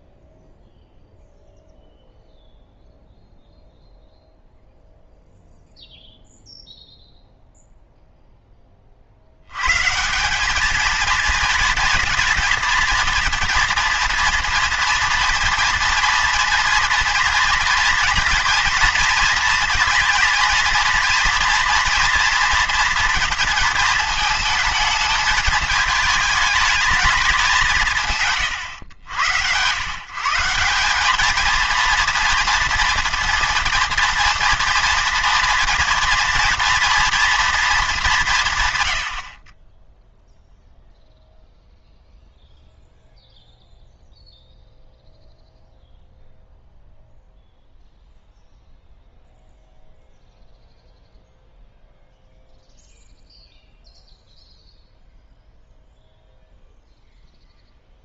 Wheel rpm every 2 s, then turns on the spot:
0, 0, 0, 0, 20, 210, 230, 230, 230, 230, 230, 230, 220, 210, 110, 190, 230, 230, 240, 120, 0, 0, 0, 0, 0, 0, 0, 0, 0.
none